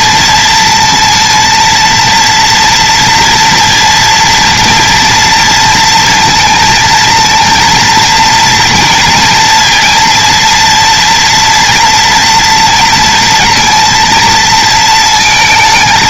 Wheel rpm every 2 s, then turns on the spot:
230, 240, 230, 230, 230, 230, 230, 220.
none